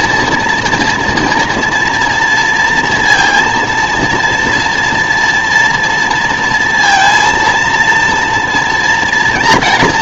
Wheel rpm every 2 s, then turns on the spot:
240, 230, 230, 230, 240.
none